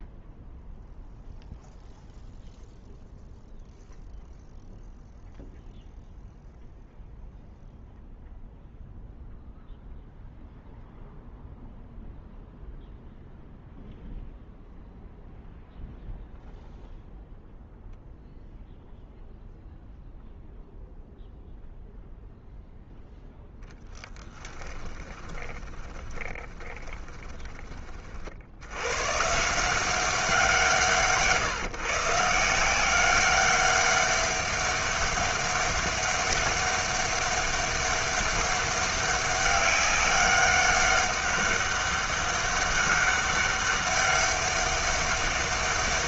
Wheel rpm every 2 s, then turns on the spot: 0, 0, 0, 0, 0, 0, 0, 0, 0, 0, 0, 0, 10, 20, 90, 170, 180, 200, 200, 200, 200, 200, 200.
24-28